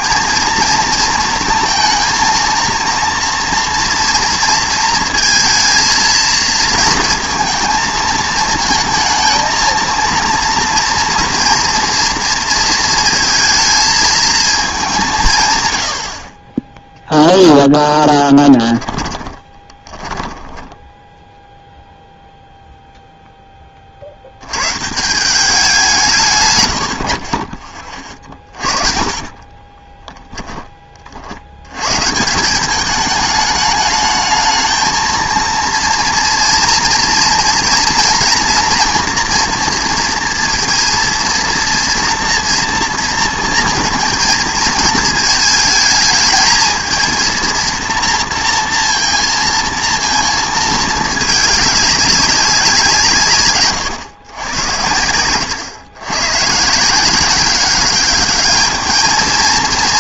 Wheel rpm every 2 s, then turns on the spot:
230, 230, 230, 230, 220, 230, 230, 210, 20, 10, 10, 0, 110, 110, 20, 20, 190, 220, 230, 230, 230, 230, 220, 220, 230, 220, 190, 100, 140, 210.
18-22 28-30